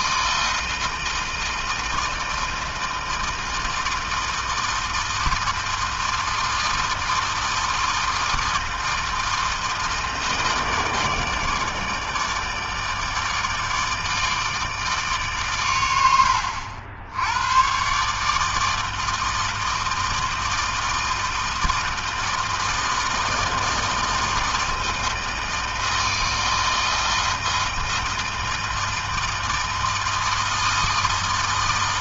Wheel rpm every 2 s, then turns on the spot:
160, 160, 160, 160, 160, 160, 160, 150, 90, 160, 160, 160, 160, 160, 160, 160.
none